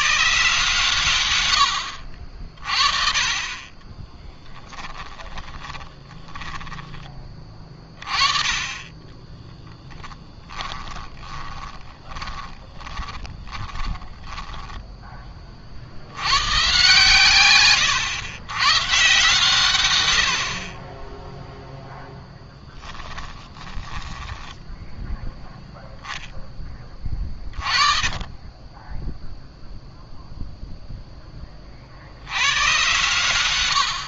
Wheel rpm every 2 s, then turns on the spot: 130, 40, 10, 20, 20, 10, 20, 10, 120, 120, 30, 10, 0, 20, 10, 0, 120.
4-6 8-14